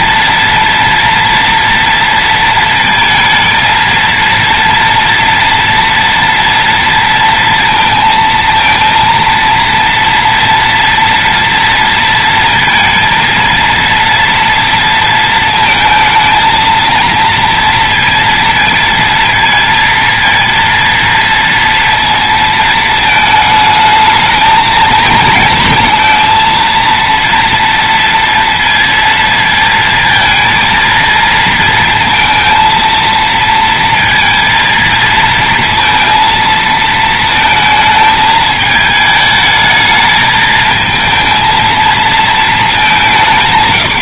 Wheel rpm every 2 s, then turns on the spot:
230, 230, 230, 230, 230, 230, 230, 230, 230, 230, 230, 220, 230, 230, 230, 230, 230, 230, 230, 220, 220, 210.
none